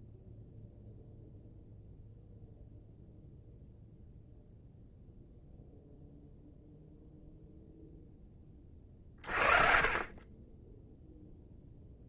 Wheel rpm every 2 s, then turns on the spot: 0, 0, 0, 0, 40, 0.
none